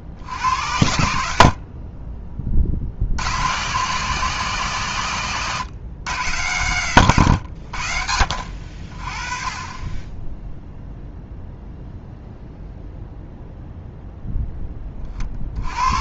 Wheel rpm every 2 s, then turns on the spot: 80, 50, 140, 120, 40, 0, 0, 20.
none